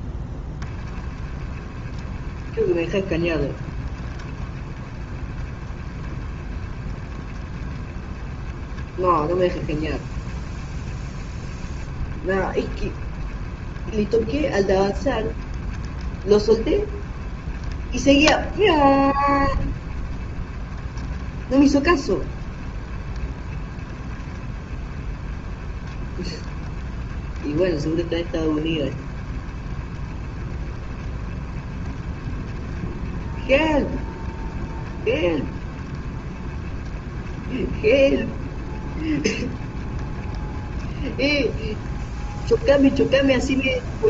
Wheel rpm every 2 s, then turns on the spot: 20, 20, 20, 20, 20, 30, 20, 20, 30, 20, 20, 20, 20, 20, 20, 20, 30, 20, 30, 30, 20, 30.
0-44